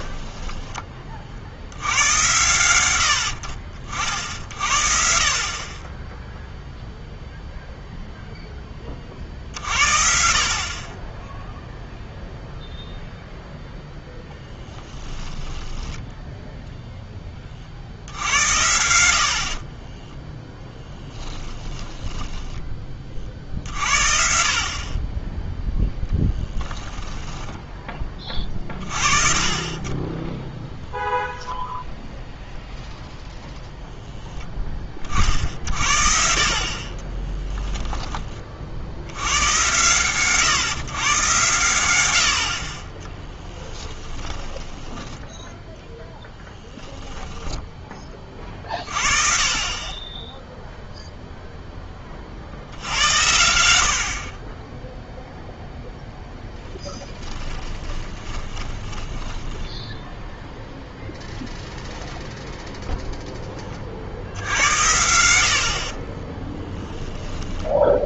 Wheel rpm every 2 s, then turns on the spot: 20, 100, 50, 0, 20, 30, 0, 10, 10, 70, 10, 20, 40, 10, 30, 0, 0, 20, 40, 60, 140, 40, 20, 10, 30, 0, 70, 10, 10, 20, 0, 0, 70, 10.
14-16 20-22 26-28 44-48 58-60 64-68